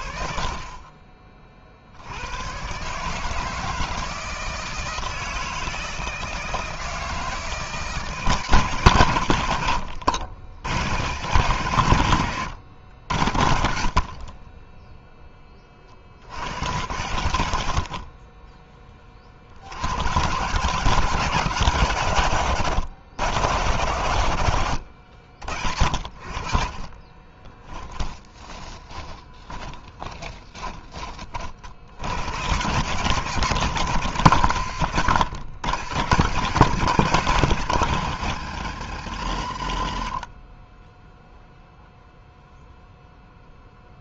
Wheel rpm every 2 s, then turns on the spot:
30, 110, 160, 160, 160, 90, 110, 20, 90, 20, 120, 130, 60, 40, 30, 30, 90, 130, 170, 130, 50, 0.
26-32